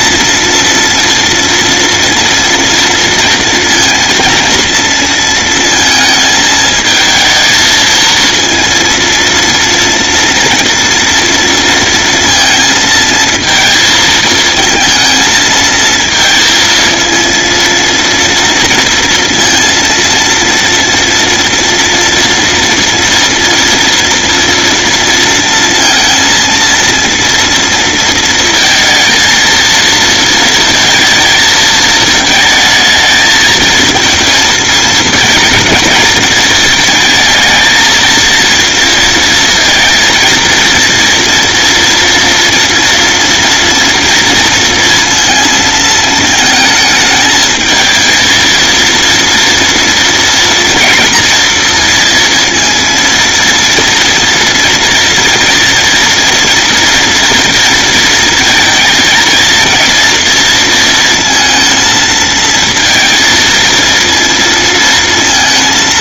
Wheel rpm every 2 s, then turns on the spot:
230, 230, 230, 220, 230, 230, 220, 220, 230, 230, 230, 230, 230, 230, 230, 220, 220, 220, 220, 230, 230, 230, 230, 220, 230, 230, 230, 240, 230, 230, 230, 230, 230.
none